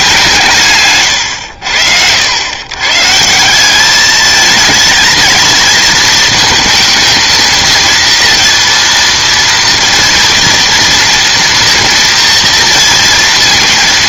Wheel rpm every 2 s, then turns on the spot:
150, 100, 220, 220, 230, 230, 230.
none